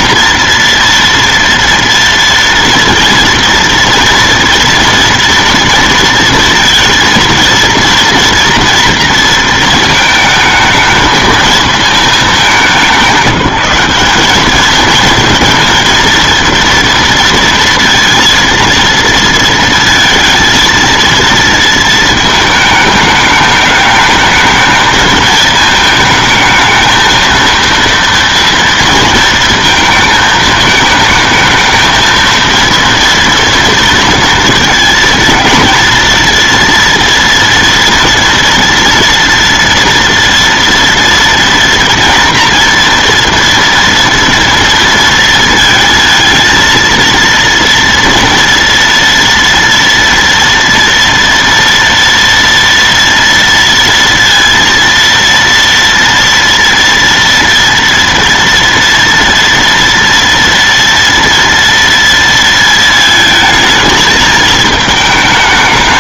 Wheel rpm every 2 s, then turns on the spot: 240, 230, 230, 230, 230, 220, 190, 210, 230, 230, 230, 220, 220, 220, 230, 220, 230, 230, 240, 230, 230, 230, 230, 220, 230, 230, 230, 230, 230, 230, 230, 230, 220.
none